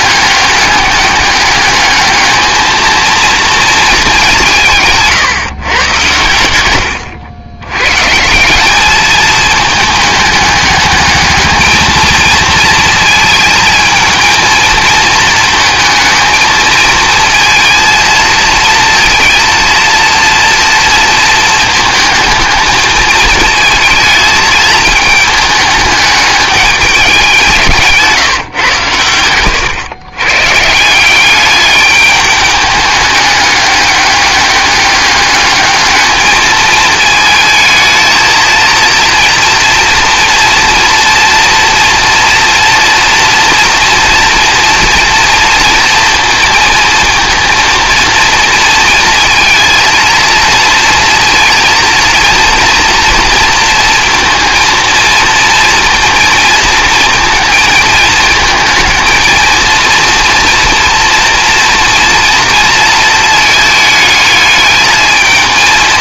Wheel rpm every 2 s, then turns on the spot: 200, 230, 160, 100, 200, 210, 230, 230, 230, 230, 230, 220, 220, 200, 120, 160, 210, 210, 220, 230, 240, 240, 230, 230, 230, 230, 240, 230, 230, 230, 230, 230, 220.
none